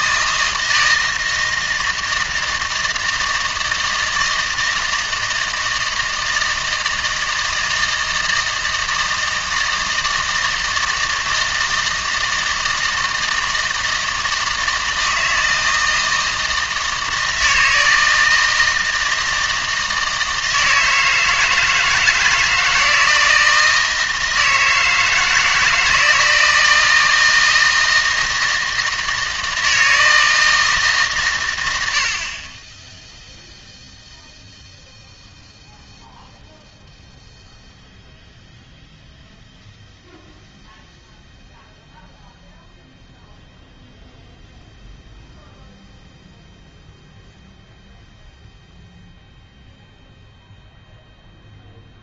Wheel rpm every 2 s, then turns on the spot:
160, 160, 160, 170, 160, 160, 160, 160, 160, 160, 160, 160, 160, 160, 160, 160, 70, 0, 0, 0, 0, 0, 0, 0, 0, 0.
none